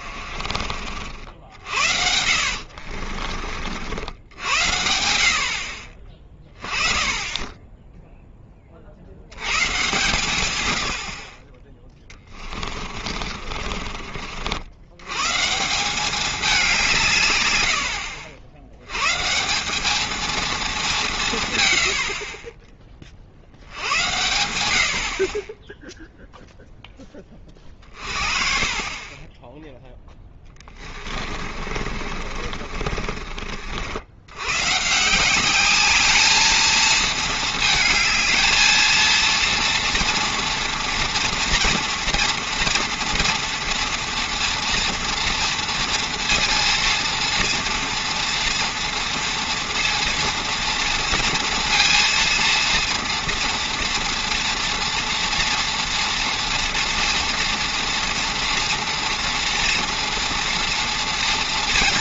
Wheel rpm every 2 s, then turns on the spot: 40, 60, 90, 20, 30, 100, 30, 80, 200, 90, 220, 40, 70, 0, 40, 20, 40, 120, 220, 220, 240, 230, 230, 230, 230, 230, 230, 240, 230, 230, 240.
2-4 12-14 28-34